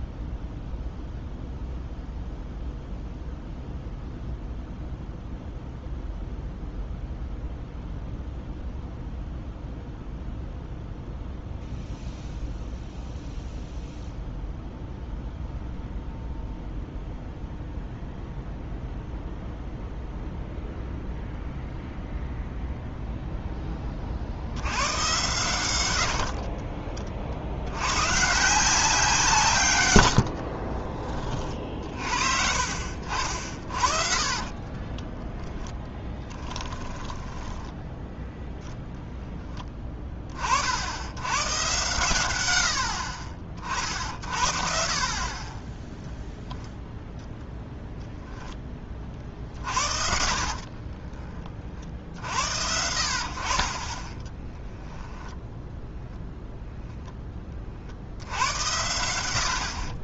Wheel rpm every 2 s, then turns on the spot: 0, 0, 0, 0, 0, 0, 0, 0, 0, 0, 0, 0, 90, 40, 180, 40, 50, 30, 10, 0, 70, 100, 60, 0, 20, 40, 70, 20, 10, 80.
26-28 30-32 34-38 50-52 54-56